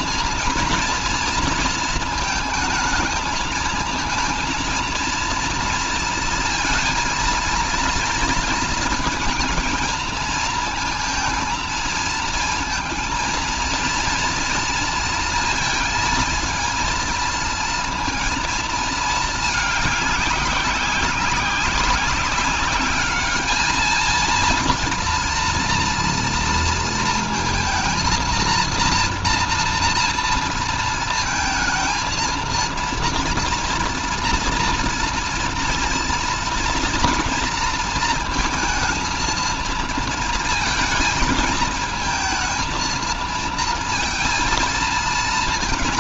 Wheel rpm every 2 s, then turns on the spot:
230, 220, 230, 230, 230, 230, 230, 230, 230, 230, 190, 200, 230, 230, 230, 230, 230, 230, 230, 230, 220, 230, 230.
none